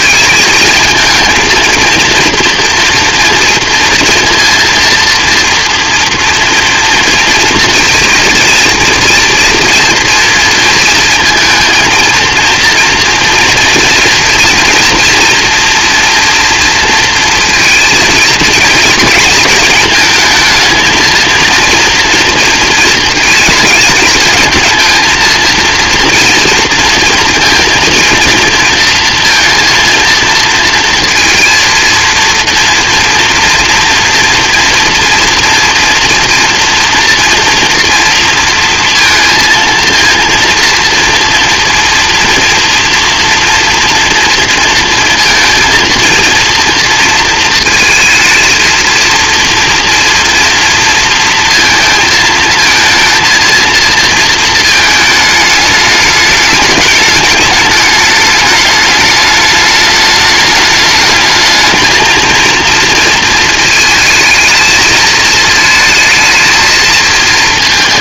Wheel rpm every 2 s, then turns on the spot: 220, 240, 230, 230, 230, 230, 230, 240, 230, 230, 230, 230, 230, 230, 230, 230, 230, 240, 230, 230, 230, 230, 230, 230, 230, 230, 230, 220, 210, 210, 220, 230, 220, 220.
none